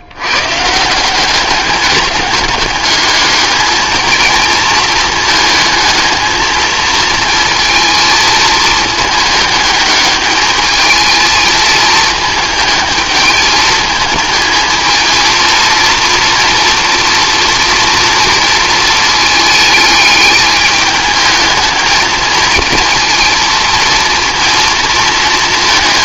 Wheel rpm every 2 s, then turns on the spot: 150, 210, 230, 230, 220, 220, 220, 230, 240, 230, 210, 220, 230.
none